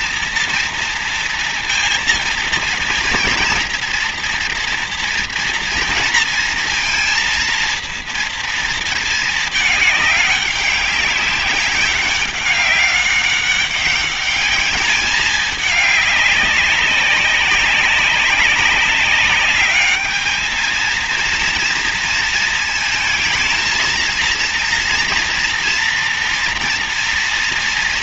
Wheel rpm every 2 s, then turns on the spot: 230, 240, 230, 230, 230, 200, 190, 210, 200, 190, 220, 230, 230, 230.
none